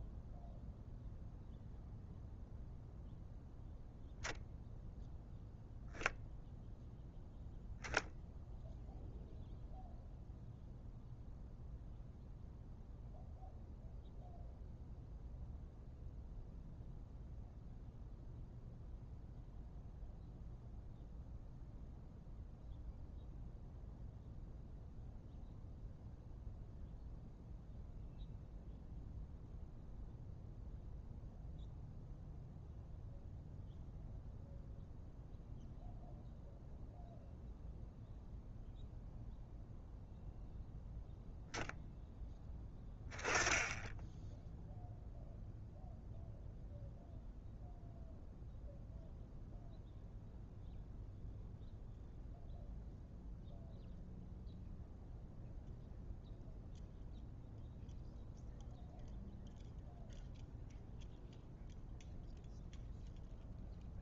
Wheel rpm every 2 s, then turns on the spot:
0, 0, 0, 0, 0, 0, 0, 0, 0, 0, 0, 0, 0, 0, 0, 0, 0, 0, 0, 0, 0, 10, 0, 0, 0, 0, 0, 0, 0, 0, 0, 0.
none